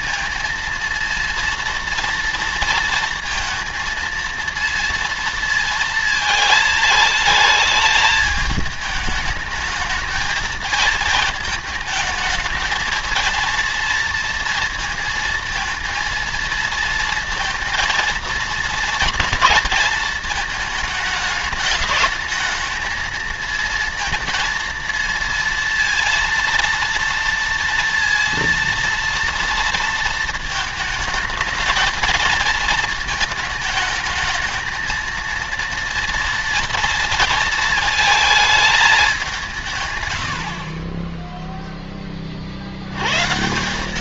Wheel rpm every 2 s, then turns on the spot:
230, 230, 230, 220, 210, 220, 220, 230, 220, 230, 220, 220, 230, 230, 230, 220, 220, 230, 230, 200, 20, 100.
none